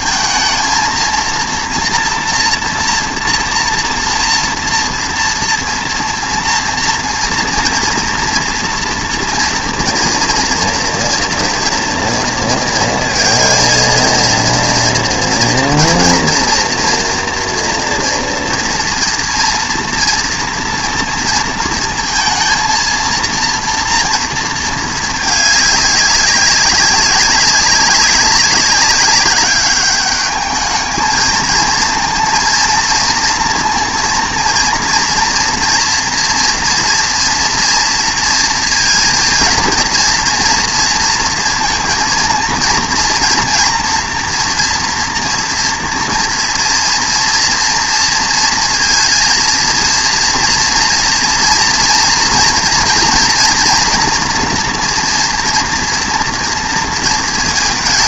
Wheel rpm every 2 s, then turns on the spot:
230, 230, 230, 230, 230, 230, 230, 230, 230, 230, 230, 230, 230, 200, 200, 210, 230, 230, 230, 230, 230, 230, 230, 230, 230, 230, 230, 230, 230.
none